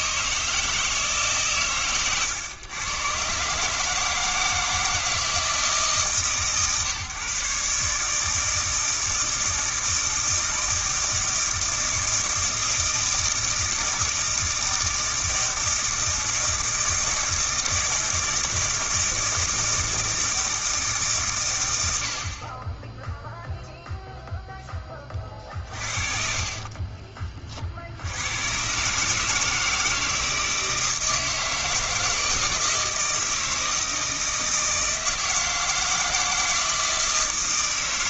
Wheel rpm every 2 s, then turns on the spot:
160, 110, 160, 140, 160, 160, 160, 160, 160, 160, 160, 20, 10, 40, 120, 160, 160, 160, 160.
26-28